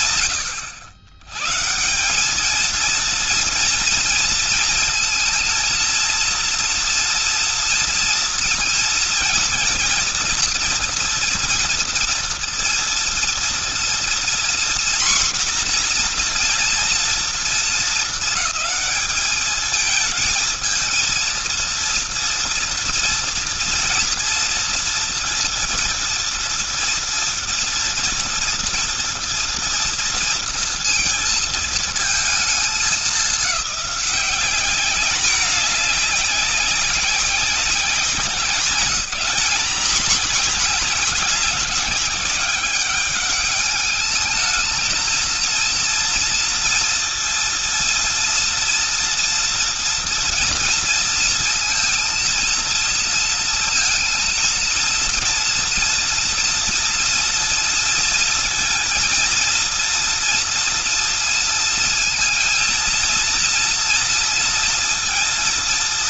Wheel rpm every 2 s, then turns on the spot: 110, 220, 230, 230, 230, 230, 230, 250, 240, 220, 220, 230, 230, 230, 240, 230, 220, 200, 200, 190, 210, 200, 220, 230, 230, 230, 230, 230, 230, 230, 230, 230, 230.
none